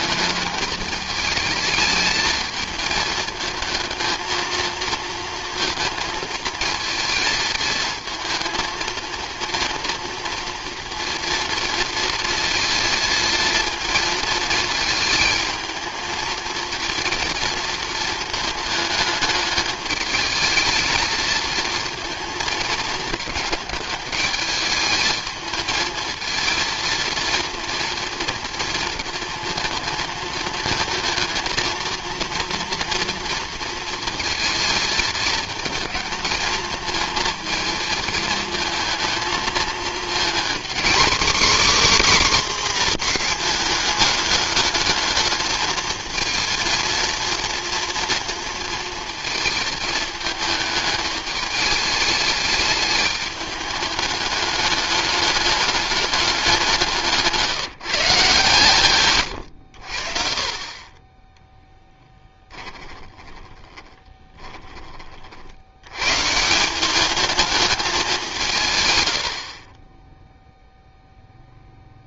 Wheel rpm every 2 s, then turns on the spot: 220, 220, 230, 220, 220, 230, 230, 220, 230, 220, 220, 220, 210, 220, 230, 220, 230, 230, 220, 220, 250, 250, 210, 230, 230, 220, 210, 210, 180, 130, 30, 10, 20, 180, 140, 0.
62-64